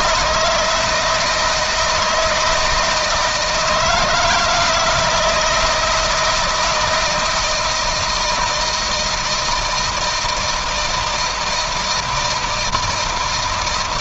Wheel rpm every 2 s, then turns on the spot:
160, 160, 160, 160, 160, 170, 160.
none